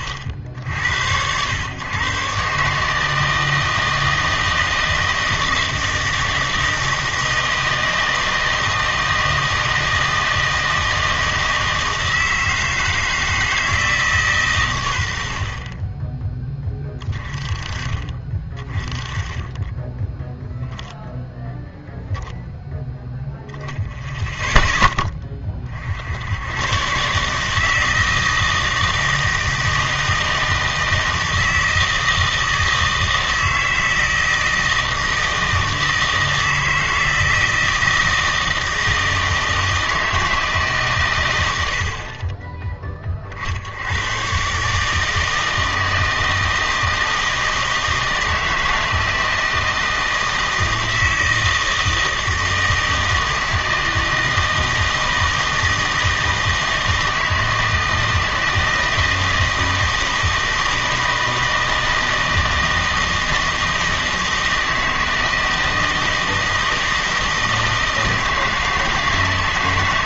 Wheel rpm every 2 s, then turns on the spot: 80, 150, 160, 160, 160, 160, 160, 110, 20, 20, 0, 0, 10, 120, 160, 160, 160, 160, 160, 160, 140, 20, 150, 160, 160, 160, 160, 160, 160, 160, 160, 160, 160, 160, 160.
none